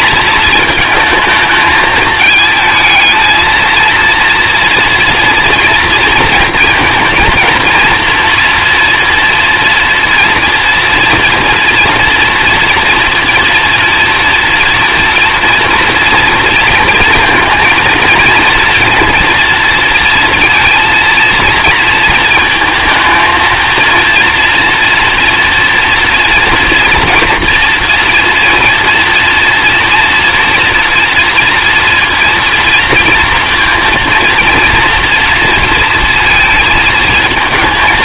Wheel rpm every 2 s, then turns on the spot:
220, 220, 230, 230, 240, 230, 230, 230, 230, 230, 230, 220, 230, 230, 230, 230, 230, 230, 220.
none